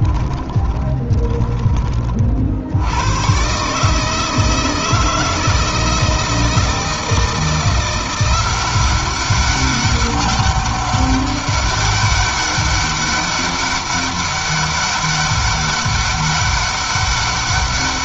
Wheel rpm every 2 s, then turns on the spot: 20, 70, 160, 160, 190, 200, 200, 200, 200.
0-2